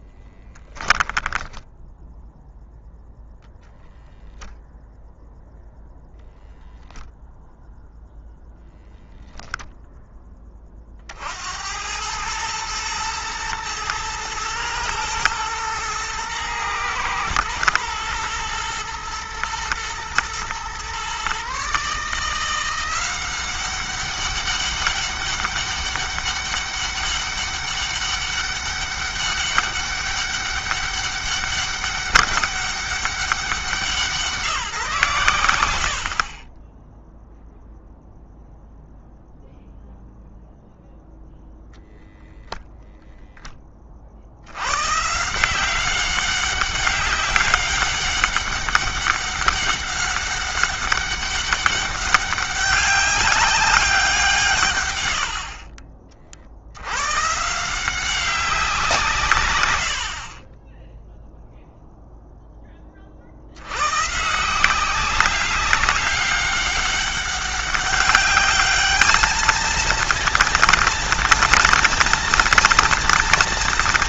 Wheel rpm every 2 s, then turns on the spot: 10, 0, 0, 0, 0, 40, 110, 110, 110, 120, 130, 180, 200, 200, 200, 200, 200, 140, 10, 0, 0, 0, 120, 200, 200, 200, 200, 130, 90, 160, 10, 20, 180, 200, 210, 230, 230.
none